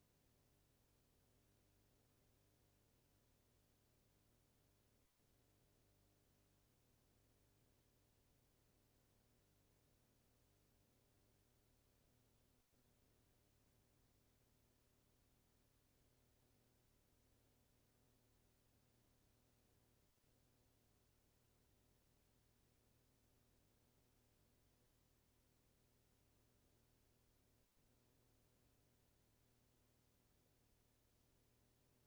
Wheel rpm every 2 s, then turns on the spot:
0, 0, 0, 0, 0, 0, 0, 0, 0, 0, 0, 0, 0, 0, 0, 0.
none